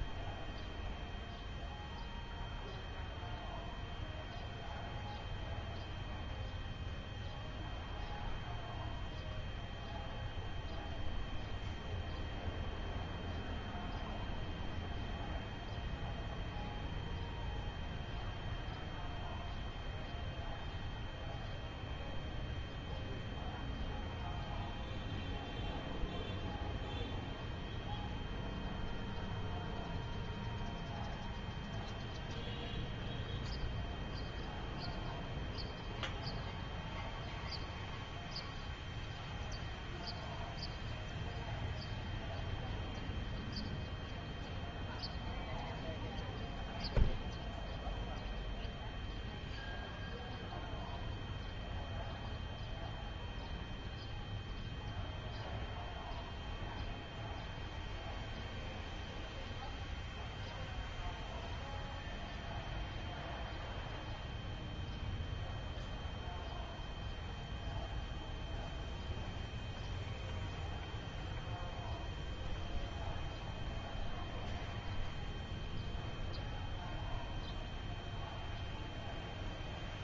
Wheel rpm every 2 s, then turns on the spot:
0, 0, 0, 0, 0, 0, 0, 0, 0, 0, 0, 0, 0, 0, 0, 0, 0, 0, 0, 0, 0, 0, 0, 0, 0, 0, 0, 0, 0, 0, 0, 0, 0, 0, 0, 0, 0, 0, 0, 0.
none